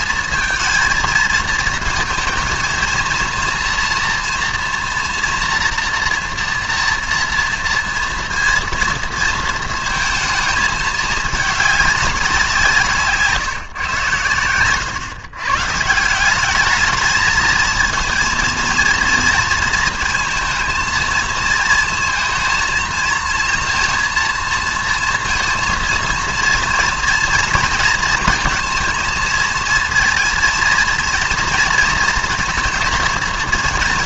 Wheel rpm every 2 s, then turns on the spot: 230, 230, 230, 230, 230, 220, 170, 110, 210, 230, 230, 220, 230, 230, 230, 230, 230.
none